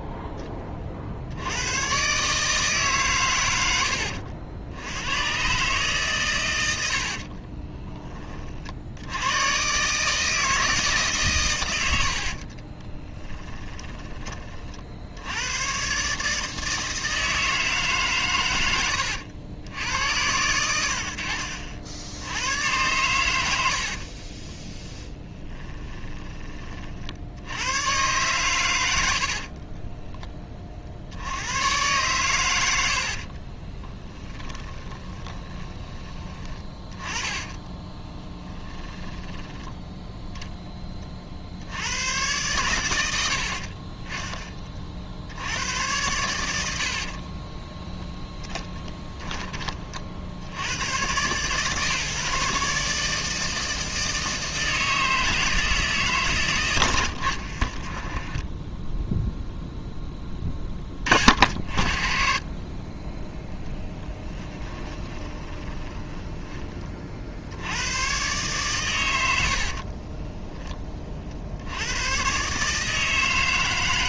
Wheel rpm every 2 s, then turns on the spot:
30, 150, 90, 80, 70, 150, 20, 50, 160, 110, 90, 100, 20, 40, 100, 40, 70, 20, 20, 20, 20, 100, 50, 70, 10, 100, 150, 160, 110, 10, 30, 20, 20, 30, 120, 20, 150.
12-14 24-26 34-40 46-50 58-60 64-66